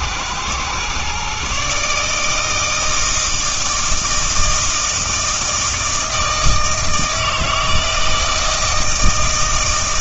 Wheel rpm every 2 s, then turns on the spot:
120, 160, 160, 160, 160.
none